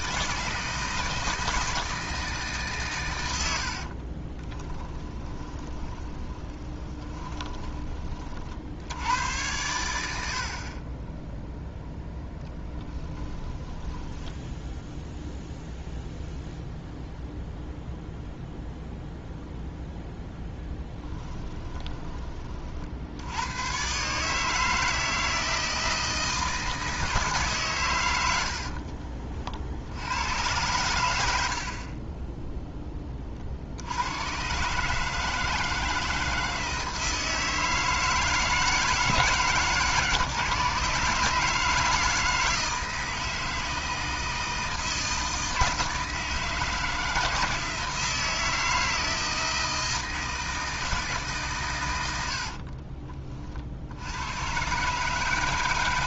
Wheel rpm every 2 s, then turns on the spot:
160, 140, 20, 30, 90, 30, 10, 0, 0, 0, 10, 60, 160, 160, 50, 100, 20, 140, 160, 160, 140, 160, 160, 160, 160, 160, 40, 130.
4-8 12-14 20-22 28-30 52-54